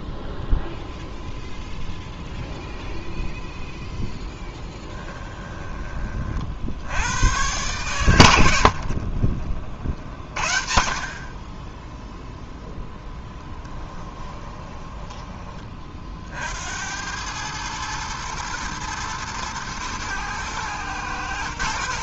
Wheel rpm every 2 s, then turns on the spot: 0, 0, 10, 60, 80, 60, 0, 20, 70, 120, 110.
4-6 14-16